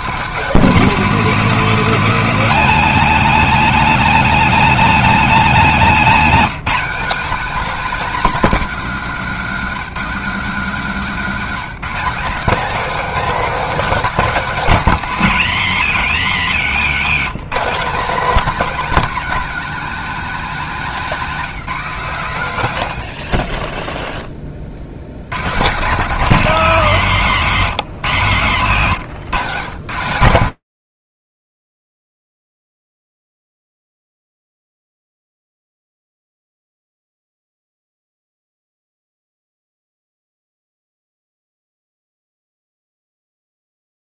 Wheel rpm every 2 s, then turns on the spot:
230, 230, 230, 210, 240, 210, 230, 200, 120, 240, 210, 100, 60, 170, 140, 90, 0, 0, 30, 70, 0, 0.
16-18